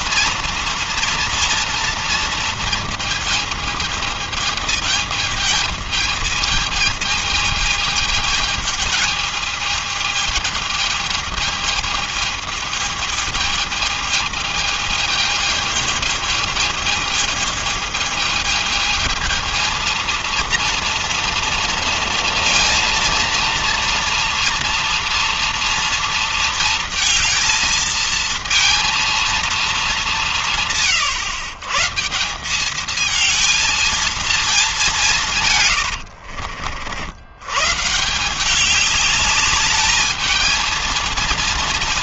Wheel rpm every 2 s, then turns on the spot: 240, 230, 220, 220, 210, 220, 220, 220, 210, 220, 230, 230, 230, 230, 230, 180, 180, 220, 70, 170, 220.
36-38